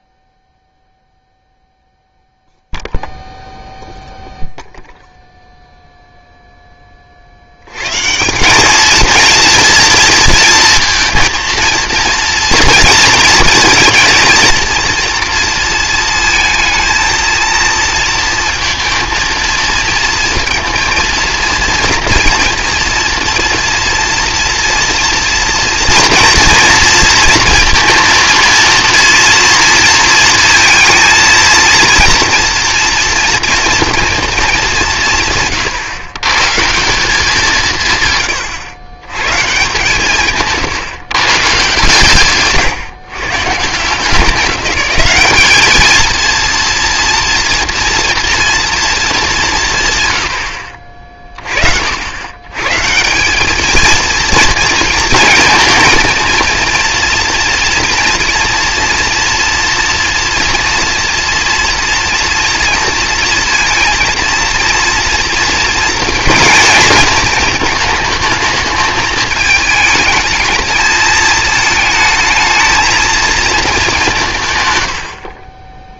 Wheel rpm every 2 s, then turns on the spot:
0, 0, 0, 10, 210, 230, 230, 230, 230, 230, 230, 230, 240, 230, 230, 230, 230, 200, 160, 100, 130, 140, 190, 230, 230, 50, 140, 220, 230, 230, 240, 230, 230, 230, 220, 220, 220, 120.
none